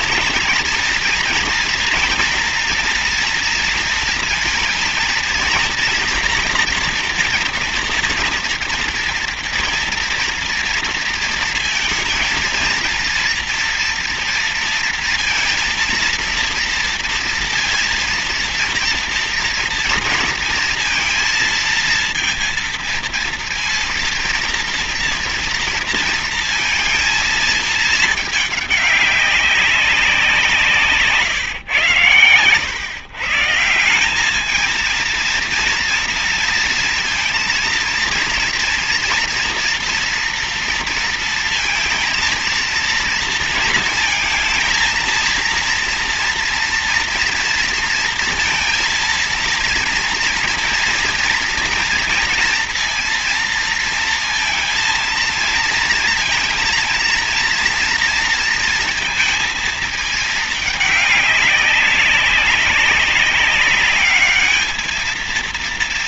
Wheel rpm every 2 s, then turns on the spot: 230, 230, 230, 230, 230, 230, 230, 230, 230, 230, 230, 230, 230, 230, 210, 180, 120, 210, 230, 230, 230, 230, 230, 230, 230, 230, 230, 230, 230, 230, 210, 200, 210.
none